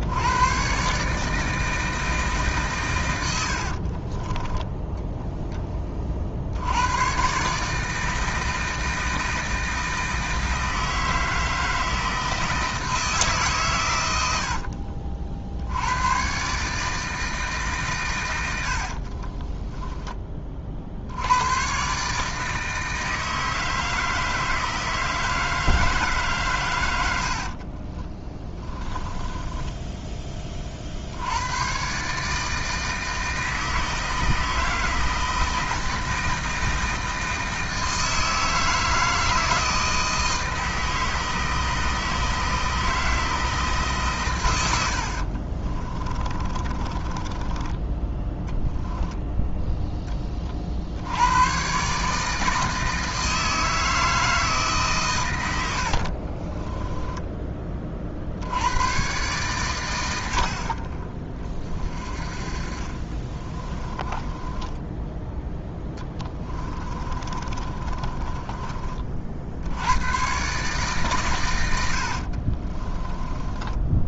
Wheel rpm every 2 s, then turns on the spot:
130, 130, 10, 100, 160, 160, 160, 50, 150, 70, 50, 160, 160, 110, 10, 50, 160, 160, 160, 160, 160, 160, 80, 30, 10, 60, 160, 140, 10, 110, 40, 30, 10, 20, 30, 140, 30.
4-6 14-16 18-20 28-30 44-48 56-58 64-68 72-74